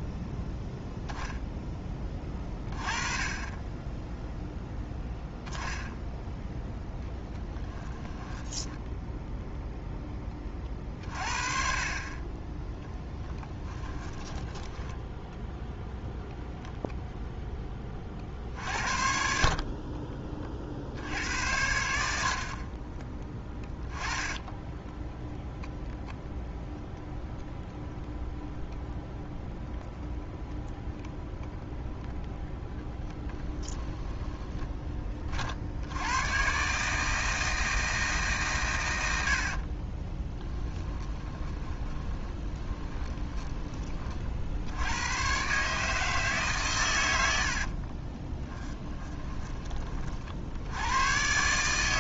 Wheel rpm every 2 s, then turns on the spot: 10, 30, 10, 10, 10, 40, 10, 10, 0, 50, 60, 30, 10, 0, 0, 0, 10, 20, 150, 100, 20, 20, 90, 110, 20, 100.
8-10 12-16 22-24 40-44 48-50